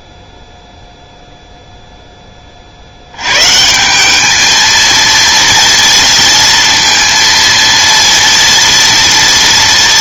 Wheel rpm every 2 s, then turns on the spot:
0, 30, 220, 230, 230.
none